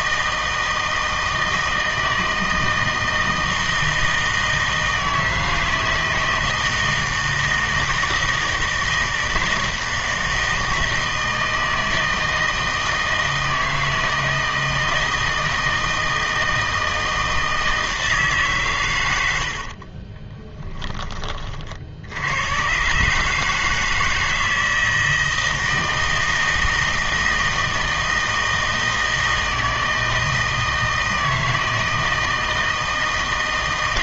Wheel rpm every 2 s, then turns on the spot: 160, 160, 160, 160, 160, 160, 160, 160, 160, 140, 10, 120, 160, 160, 160, 160, 160.
none